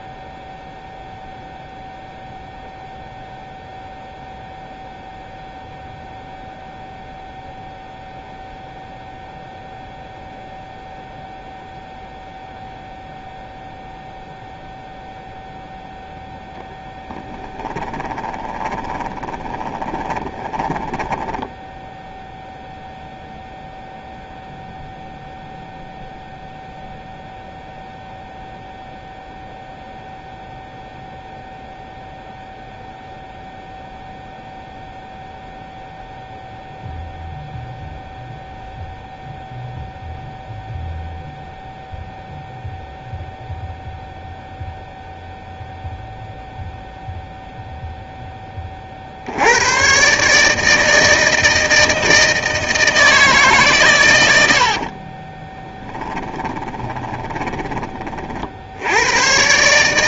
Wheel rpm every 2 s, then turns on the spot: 0, 0, 0, 0, 0, 0, 0, 0, 0, 20, 10, 0, 0, 0, 0, 0, 0, 0, 0, 0, 0, 0, 0, 0, 40, 160, 160, 50, 20, 70.
18-22 54-58